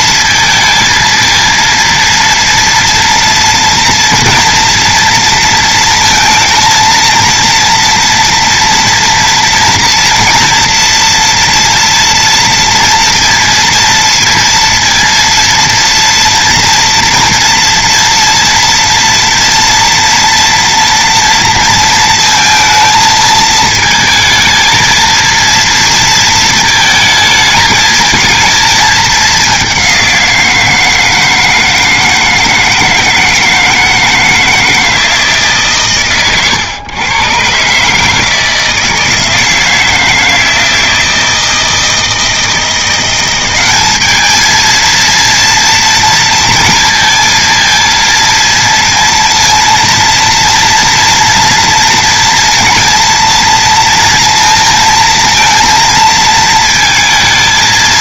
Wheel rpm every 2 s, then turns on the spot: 230, 230, 230, 230, 230, 230, 230, 230, 230, 240, 230, 230, 220, 220, 220, 170, 160, 160, 120, 160, 160, 170, 230, 230, 230, 230, 230, 230, 220.
none